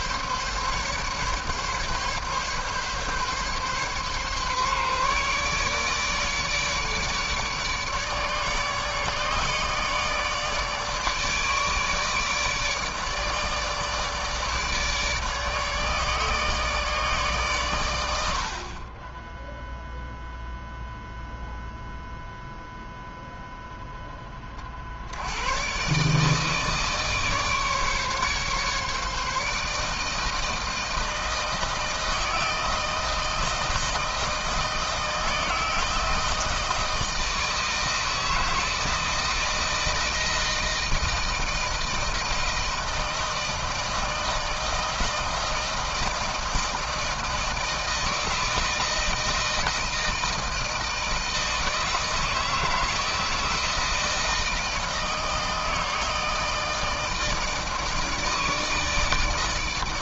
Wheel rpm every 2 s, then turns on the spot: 140, 140, 140, 150, 150, 150, 150, 150, 140, 20, 0, 0, 70, 150, 150, 160, 160, 160, 160, 160, 160, 160, 160, 160, 160, 160, 160, 160, 160, 160.
none